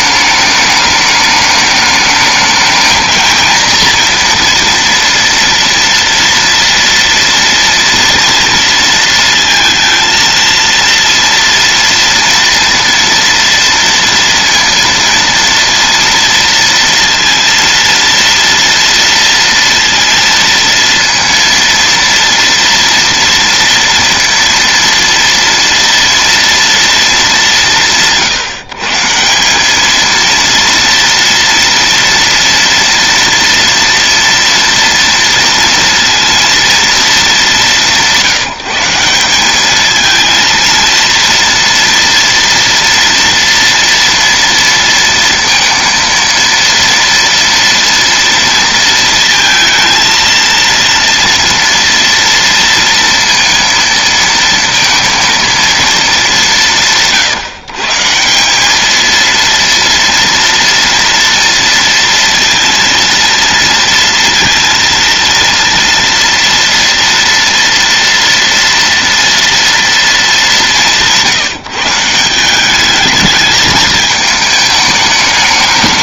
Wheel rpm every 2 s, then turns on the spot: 210, 220, 230, 230, 230, 230, 230, 230, 230, 230, 230, 230, 230, 230, 150, 230, 230, 230, 230, 170, 230, 230, 230, 230, 230, 230, 230, 230, 160, 200, 230, 230, 230, 230, 230, 190, 200, 220.
none